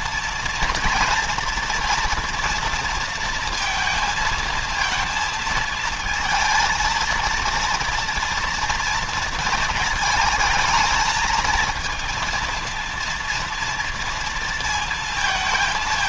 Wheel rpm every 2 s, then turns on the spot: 240, 240, 230, 220, 230, 220, 230, 230.
none